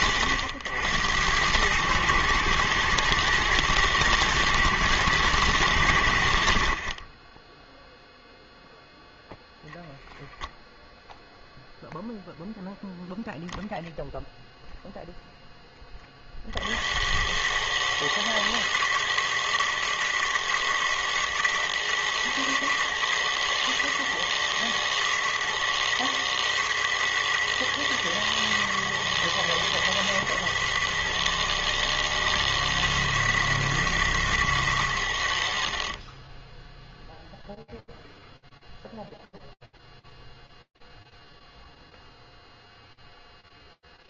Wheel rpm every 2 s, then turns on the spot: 80, 120, 110, 50, 0, 0, 0, 0, 60, 110, 110, 120, 110, 110, 110, 110, 110, 100, 0, 0, 0, 0.
none